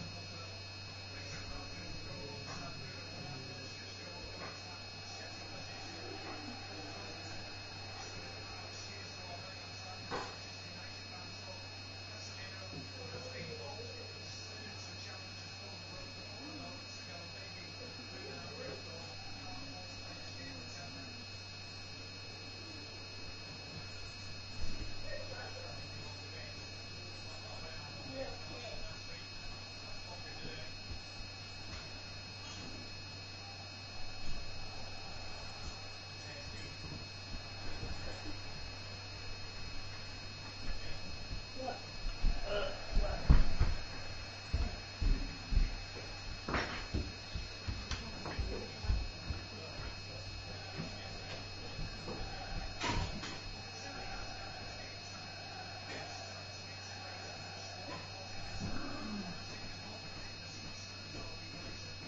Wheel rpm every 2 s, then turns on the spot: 0, 0, 0, 0, 0, 0, 0, 0, 0, 0, 0, 0, 0, 0, 0, 0, 0, 0, 0, 0, 0, 0, 0, 0, 0, 0, 0, 0, 0, 0, 0.
none